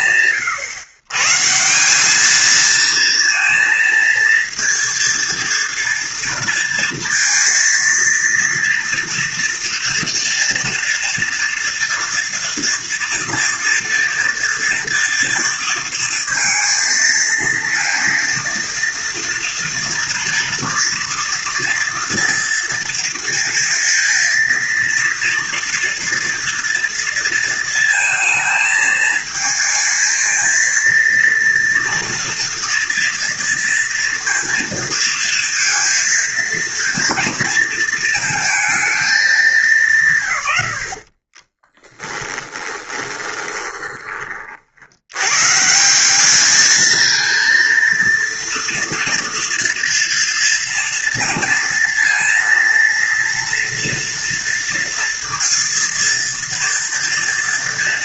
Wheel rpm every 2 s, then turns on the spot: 130, 230, 230, 230, 230, 230, 230, 230, 230, 230, 230, 230, 230, 230, 220, 230, 230, 230, 230, 210, 30, 20, 110, 230, 230, 230, 230, 230, 230.
40-44